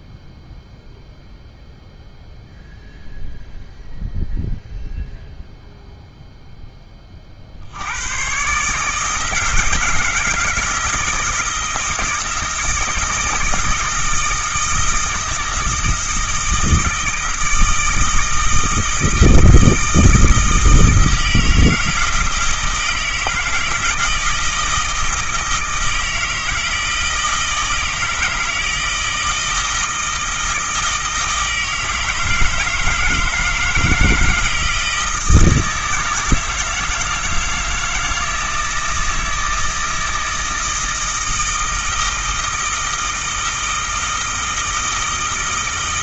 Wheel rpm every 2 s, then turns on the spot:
0, 0, 0, 10, 140, 160, 160, 160, 160, 160, 160, 160, 160, 160, 160, 160, 160, 170, 170, 160, 160, 160, 160.
none